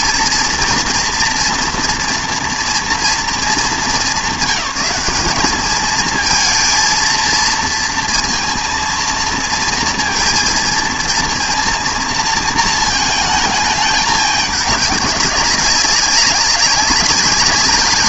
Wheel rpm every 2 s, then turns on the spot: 240, 230, 190, 230, 230, 230, 220, 210, 190.
none